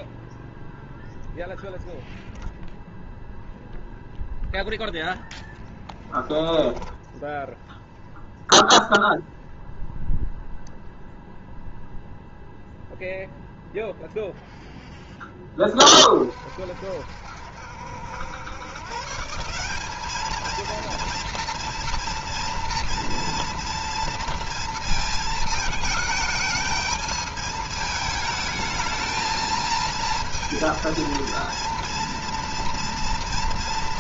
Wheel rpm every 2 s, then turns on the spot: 0, 0, 0, 0, 0, 0, 0, 10, 60, 140, 230, 230, 220, 220, 220, 230, 230.
none